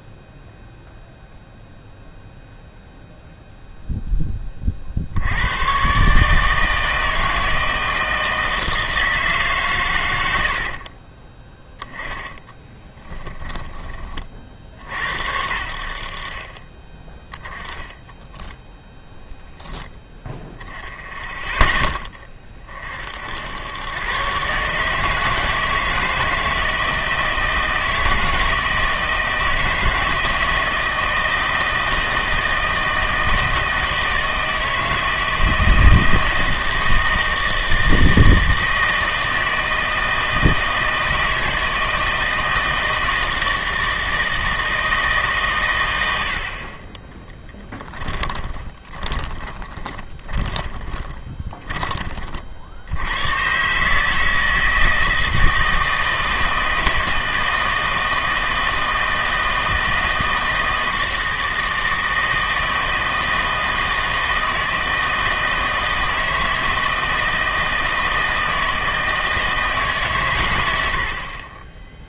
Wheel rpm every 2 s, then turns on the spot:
0, 0, 30, 160, 160, 50, 10, 60, 30, 10, 0, 30, 140, 160, 160, 160, 160, 160, 160, 160, 160, 160, 160, 40, 20, 20, 60, 160, 160, 160, 160, 160, 160, 160, 160, 110.
10-14 18-20 48-52